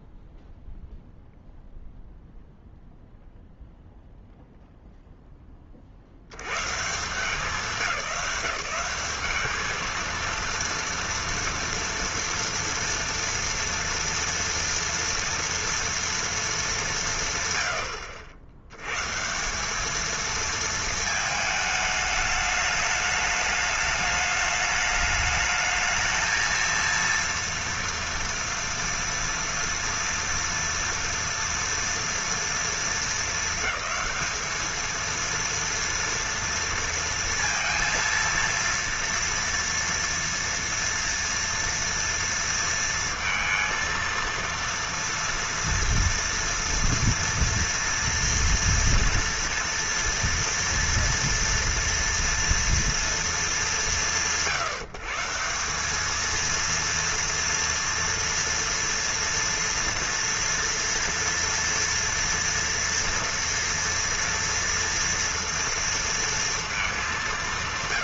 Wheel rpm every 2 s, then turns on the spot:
0, 0, 0, 130, 200, 230, 240, 230, 220, 90, 220, 210, 210, 230, 230, 230, 230, 220, 230, 230, 230, 230, 230, 230, 240, 240, 230, 150, 230, 240, 230, 230, 230, 220.
none